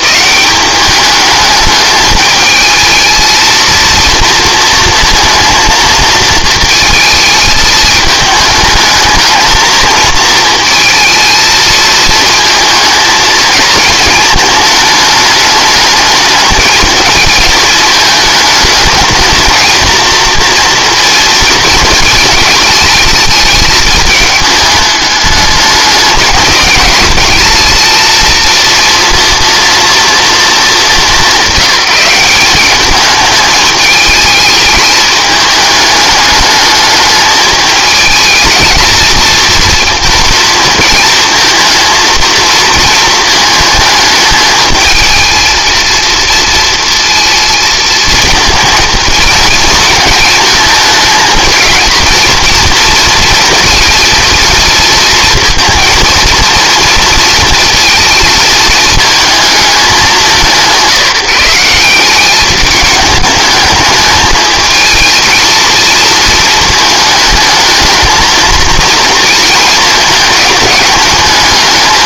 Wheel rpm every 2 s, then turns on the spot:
200, 210, 230, 220, 210, 230, 230, 220, 220, 220, 230, 220, 210, 220, 230, 210, 200, 210, 210, 230, 230, 230, 220, 230, 220, 220, 230, 230, 230, 220, 190, 200, 220, 220, 230, 210.
none